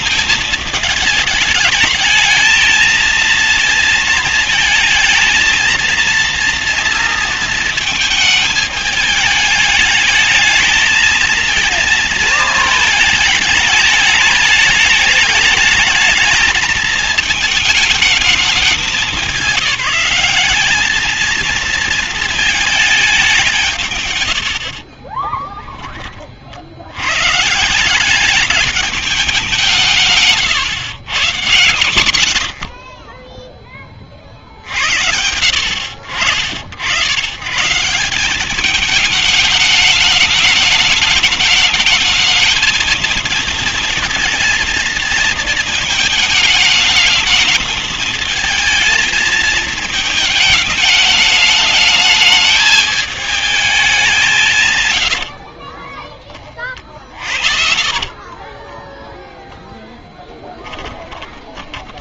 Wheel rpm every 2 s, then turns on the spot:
220, 220, 220, 230, 220, 220, 220, 210, 220, 210, 210, 230, 80, 40, 210, 140, 110, 80, 90, 200, 210, 220, 230, 210, 220, 220, 220, 160, 30, 20, 10.
24-26 58-60